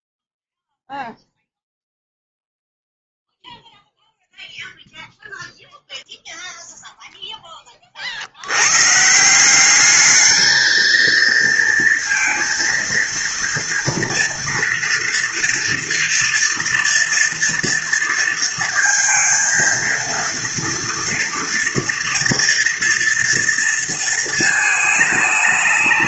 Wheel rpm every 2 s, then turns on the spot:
0, 0, 0, 0, 130, 220, 230, 230, 230, 230, 230, 230, 210.
none